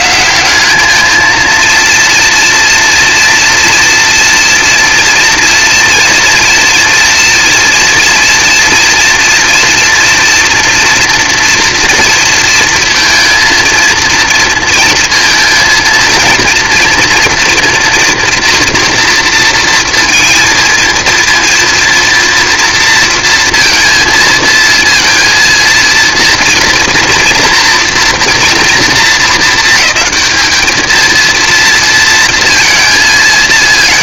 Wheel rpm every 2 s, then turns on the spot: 180, 230, 230, 230, 230, 230, 230, 230, 230, 240, 230, 230, 220, 230, 230, 220, 230.
none